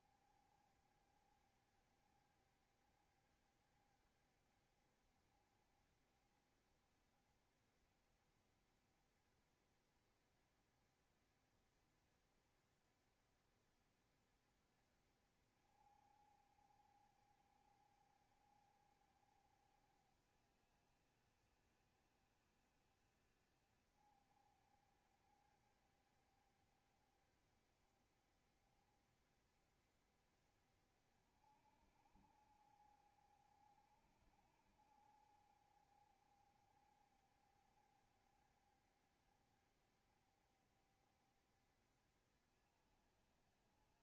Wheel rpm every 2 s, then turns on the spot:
70, 70, 70, 70, 60, 70, 70, 70, 60, 60, 60, 70, 70, 70, 70, 60, 60, 60, 70, 60, 70, 60.
none